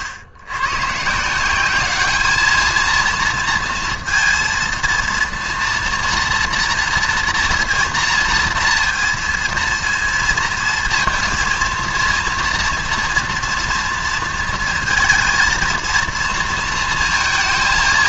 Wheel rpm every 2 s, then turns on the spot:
130, 220, 230, 230, 230, 230, 230, 230, 230.
none